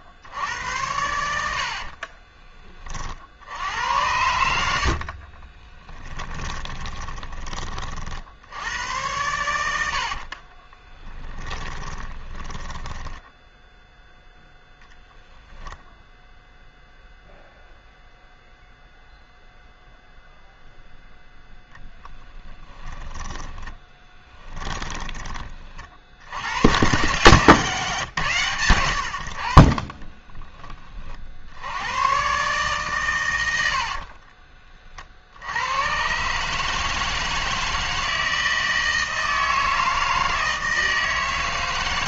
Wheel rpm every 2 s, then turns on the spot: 80, 30, 60, 20, 100, 20, 10, 0, 0, 0, 0, 10, 20, 120, 80, 40, 130, 40, 150, 160, 160.
4-8 10-14 22-24